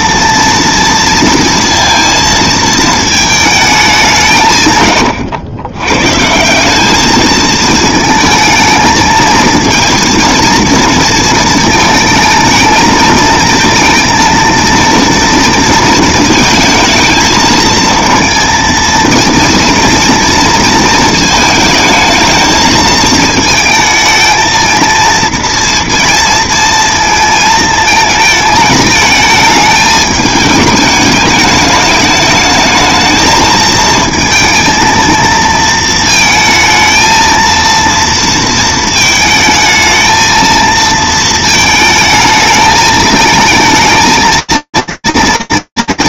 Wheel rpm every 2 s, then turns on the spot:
230, 220, 150, 190, 220, 230, 220, 230, 220, 230, 230, 220, 230, 230, 220, 220, 220, 220, 230, 230, 230, 220, 230.
none